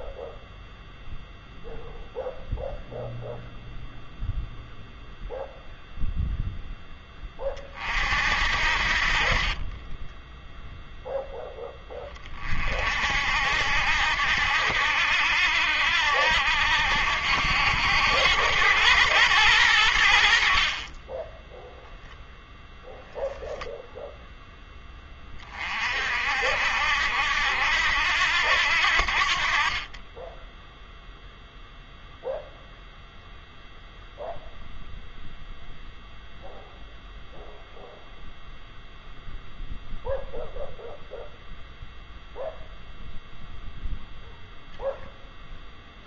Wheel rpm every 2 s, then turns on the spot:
0, 0, 0, 10, 60, 0, 40, 80, 80, 100, 40, 0, 10, 70, 80, 0, 0, 0, 0, 0, 0, 0, 0.
none